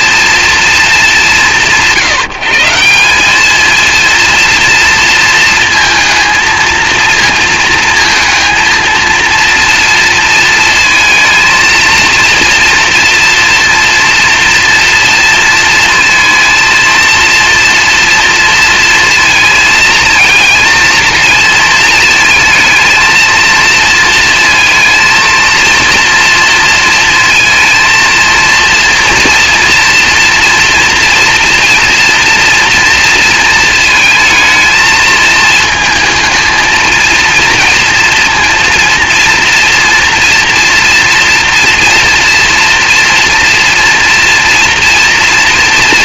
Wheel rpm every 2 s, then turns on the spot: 200, 190, 230, 230, 230, 220, 230, 230, 230, 230, 230, 220, 230, 230, 230, 240, 230, 220, 230, 230, 230, 230, 230.
none